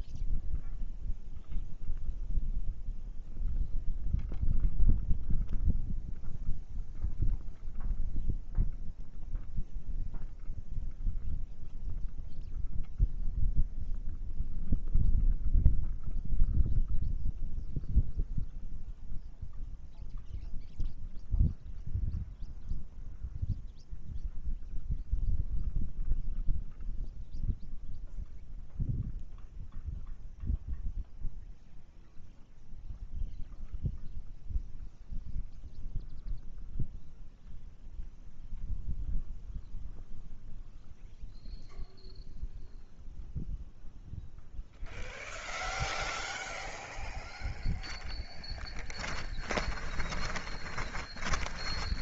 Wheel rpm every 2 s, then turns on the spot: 0, 0, 0, 0, 0, 0, 0, 0, 0, 0, 0, 0, 0, 0, 0, 0, 0, 0, 0, 0, 0, 0, 0, 0, 10, 20.
48-52